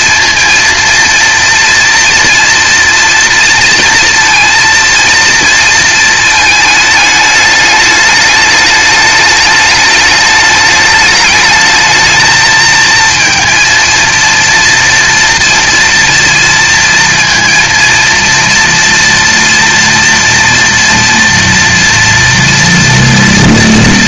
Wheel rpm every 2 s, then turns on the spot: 230, 230, 230, 220, 210, 210, 220, 230, 230, 230, 230, 230.
none